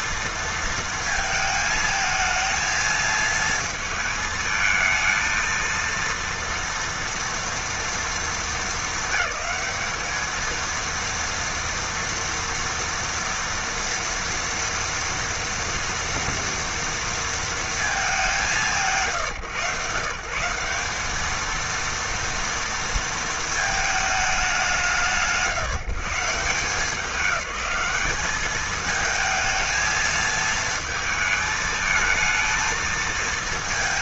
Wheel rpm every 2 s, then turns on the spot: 230, 220, 220, 230, 220, 230, 230, 230, 230, 160, 190, 230, 160, 180, 220, 220, 220.
none